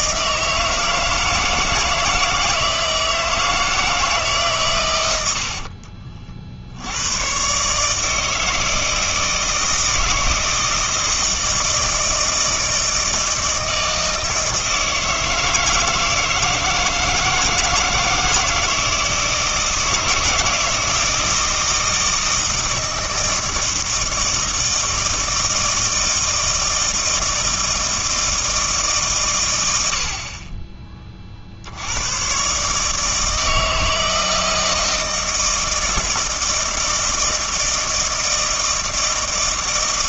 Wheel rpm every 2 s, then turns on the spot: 160, 160, 140, 60, 160, 160, 160, 160, 160, 160, 160, 160, 160, 160, 160, 30, 130, 160, 160, 160.
none